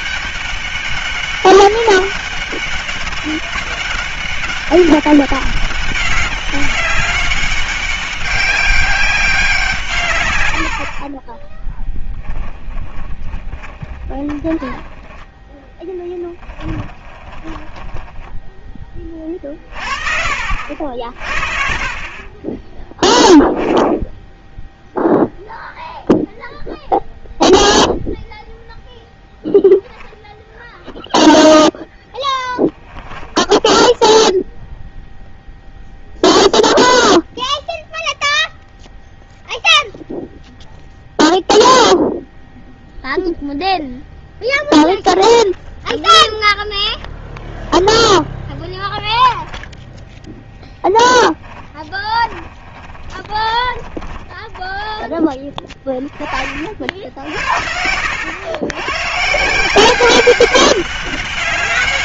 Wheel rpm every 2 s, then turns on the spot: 200, 200, 200, 200, 200, 80, 10, 20, 20, 20, 50, 20, 0, 0, 0, 0, 10, 0, 0, 0, 0, 0, 0, 0, 0, 10, 30, 20, 40, 110, 200.
12-14 16-18 32-34 52-56